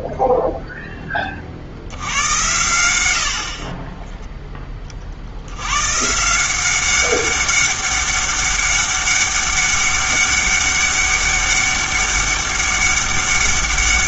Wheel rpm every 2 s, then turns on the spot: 0, 100, 20, 180, 200, 200, 200.
none